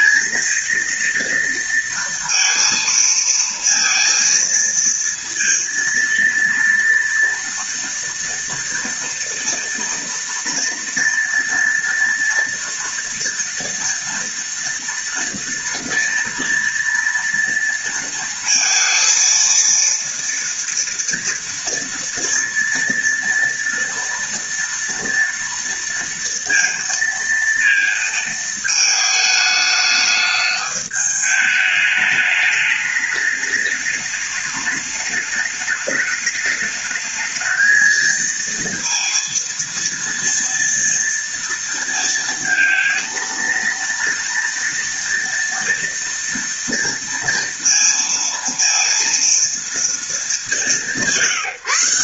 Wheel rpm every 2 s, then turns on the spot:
230, 230, 230, 230, 230, 230, 230, 230, 230, 230, 230, 230, 230, 230, 220, 210, 210, 210, 220, 230, 230, 230, 230, 230, 230, 190.
none